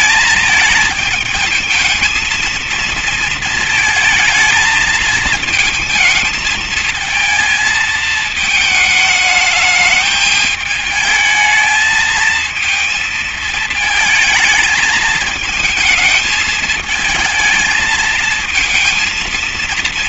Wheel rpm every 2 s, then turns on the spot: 220, 220, 220, 220, 220, 220, 220, 220, 220, 230.
none